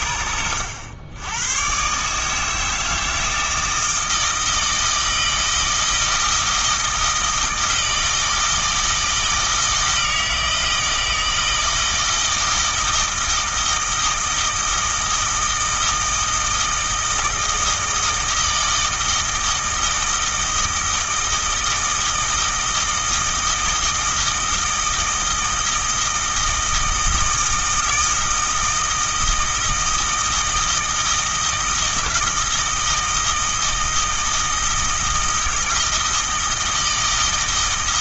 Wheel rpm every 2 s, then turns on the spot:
90, 160, 160, 160, 160, 160, 160, 160, 160, 160, 160, 160, 160, 160, 160, 160, 160, 160, 160.
none